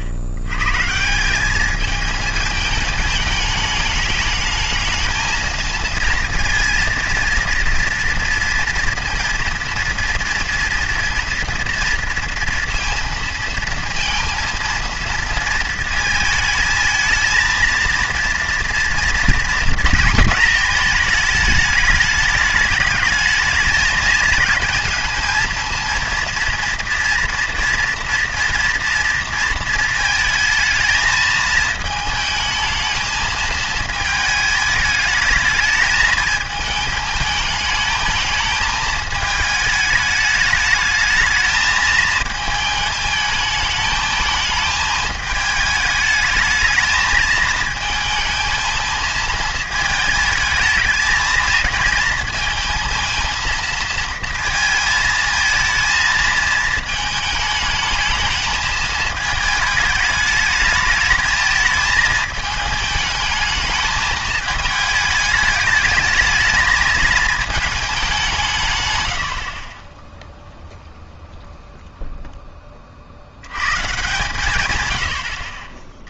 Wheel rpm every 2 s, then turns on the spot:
80, 220, 220, 230, 230, 230, 230, 230, 220, 230, 230, 210, 220, 230, 230, 220, 220, 220, 220, 220, 210, 220, 220, 220, 220, 220, 220, 220, 220, 220, 210, 220, 210, 220, 150, 0, 20, 150.
none